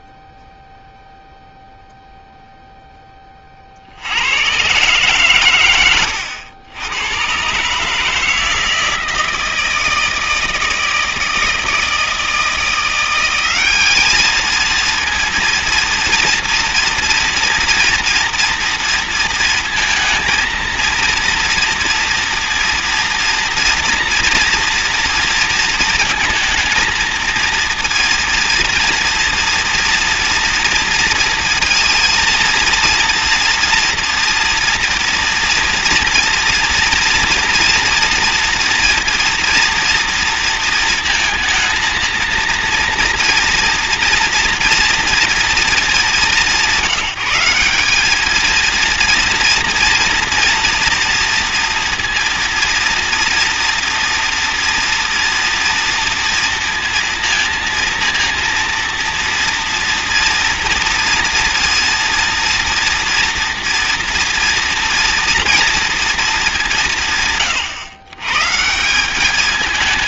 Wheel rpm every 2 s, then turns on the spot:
0, 0, 50, 110, 140, 160, 160, 200, 230, 240, 230, 230, 240, 230, 230, 230, 230, 230, 240, 240, 230, 230, 240, 220, 200, 230, 230, 230, 230, 230, 230, 230, 230, 230, 140.
none